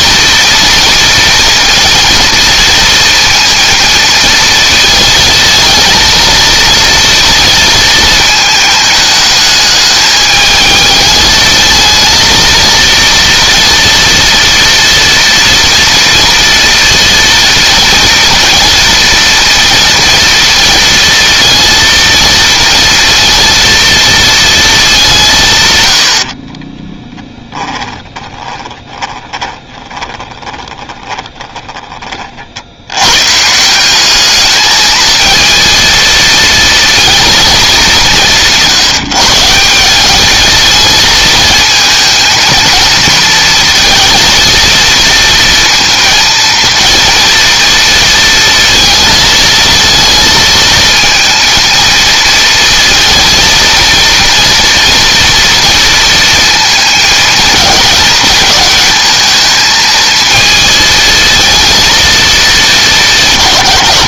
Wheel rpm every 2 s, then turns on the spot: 230, 230, 220, 230, 220, 210, 230, 230, 230, 230, 230, 230, 220, 30, 20, 20, 90, 220, 230, 170, 220, 230, 230, 230, 230, 230, 230, 230, 230, 220, 220, 200.
26-32